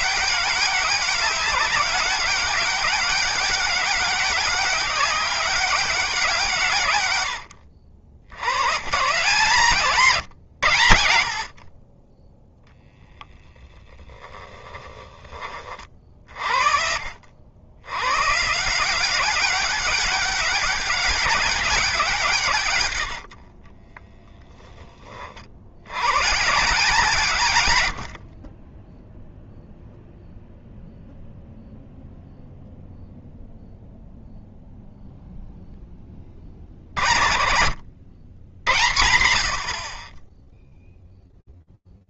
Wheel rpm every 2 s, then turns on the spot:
200, 190, 200, 130, 130, 100, 0, 10, 50, 170, 190, 130, 20, 160, 10, 0, 0, 0, 50, 110, 0.
14-16